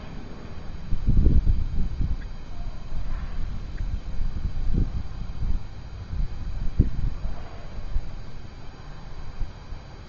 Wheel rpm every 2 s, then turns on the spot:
0, 0, 0, 0, 0.
none